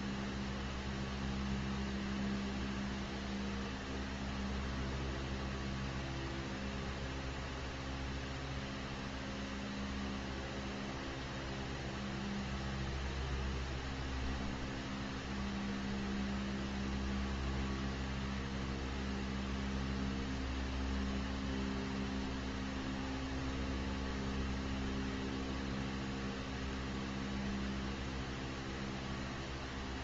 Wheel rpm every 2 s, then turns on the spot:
0, 0, 0, 0, 0, 0, 0, 0, 0, 0, 0, 0, 0, 0, 0.
none